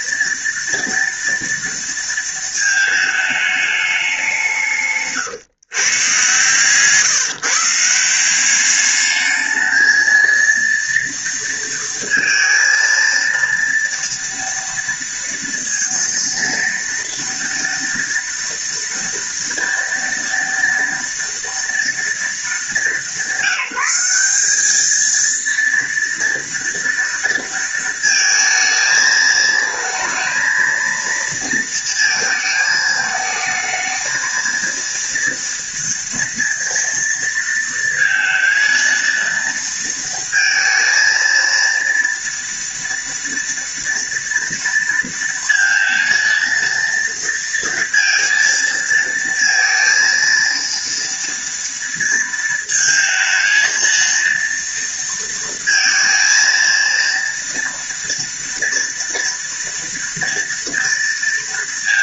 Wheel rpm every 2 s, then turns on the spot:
230, 220, 140, 150, 210, 230, 230, 230, 230, 230, 230, 200, 220, 230, 220, 230, 220, 230, 230, 230, 230, 230, 230, 230, 230, 230, 220, 230, 230, 230, 230.
none